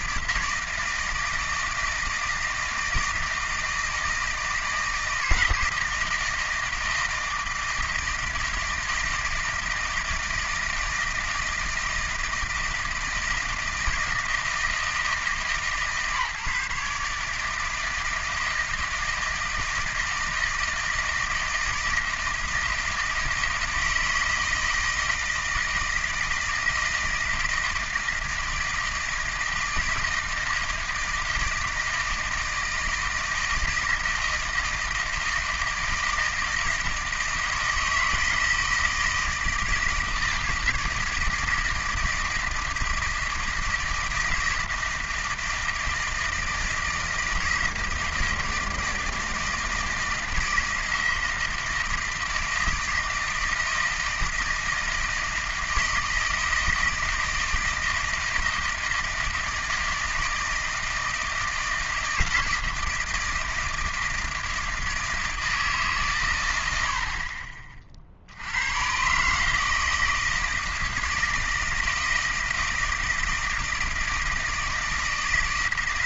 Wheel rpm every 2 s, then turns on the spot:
160, 160, 160, 160, 160, 160, 170, 160, 150, 160, 160, 160, 160, 160, 160, 160, 160, 160, 160, 160, 160, 170, 160, 160, 160, 160, 160, 160, 160, 160, 160, 160, 160, 90, 90, 160, 160, 160.
none